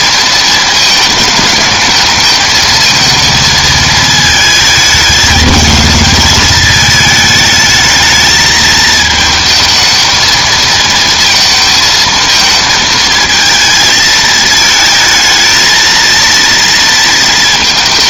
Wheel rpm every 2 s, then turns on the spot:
220, 220, 220, 220, 220, 220, 220, 220, 230.
none